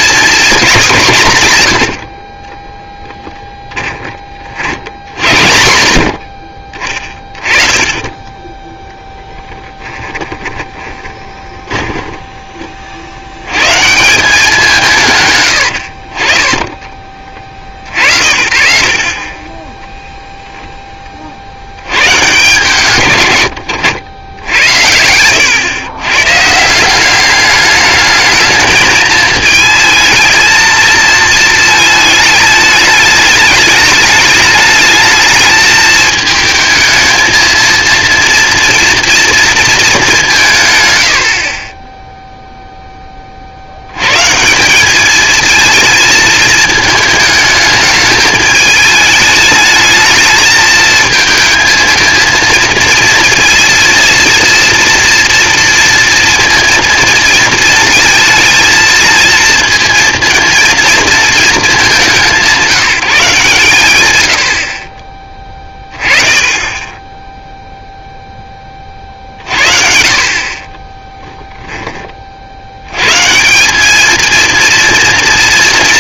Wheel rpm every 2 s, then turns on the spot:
220, 10, 70, 40, 10, 20, 30, 170, 30, 60, 0, 130, 90, 160, 220, 230, 210, 210, 220, 230, 140, 0, 180, 220, 210, 220, 230, 230, 230, 220, 230, 190, 50, 20, 20, 30, 80, 230.
2-4 6-12 70-72